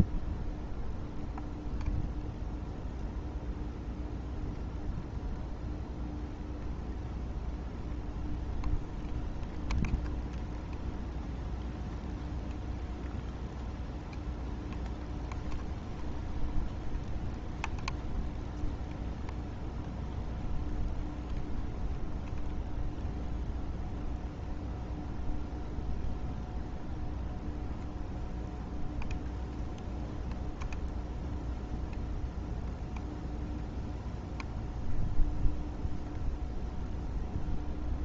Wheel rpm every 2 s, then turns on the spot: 0, 0, 0, 0, 0, 0, 0, 0, 0, 0, 0, 0, 0, 0, 0, 0, 0, 0, 0.
none